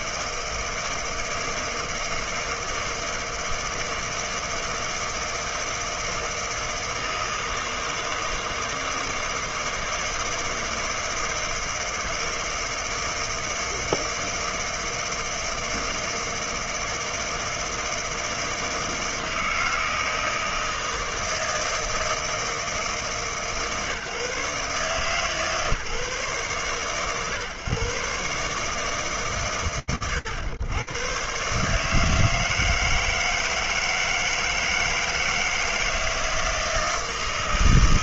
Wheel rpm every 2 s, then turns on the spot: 160, 160, 160, 160, 160, 160, 160, 160, 160, 160, 160, 150, 150, 110, 150, 130, 160, 160, 160.
none